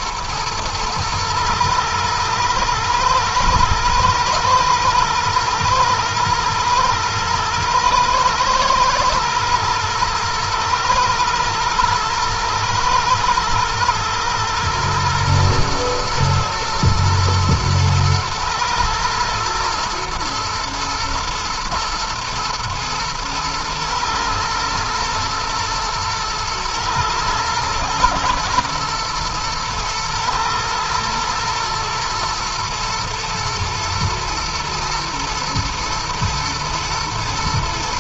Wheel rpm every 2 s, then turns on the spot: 110, 110, 110, 110, 110, 120, 110, 120, 110, 120, 120, 120, 110, 110, 120, 120, 120, 110, 110.
none